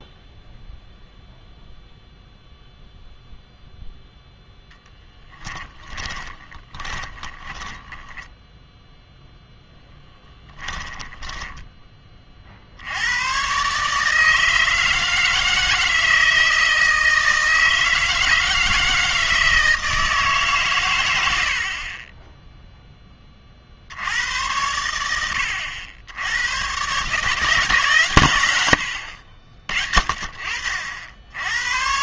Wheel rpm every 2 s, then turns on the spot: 0, 0, 0, 20, 0, 10, 70, 160, 160, 160, 130, 0, 90, 110, 110, 60.
6-8 10-12